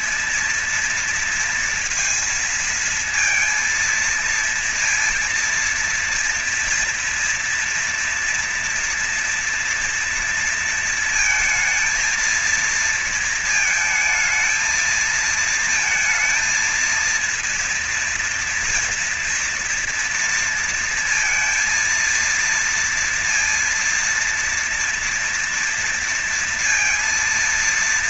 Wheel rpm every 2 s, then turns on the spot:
220, 230, 230, 230, 230, 230, 230, 230, 230, 240, 230, 230, 230, 230.
none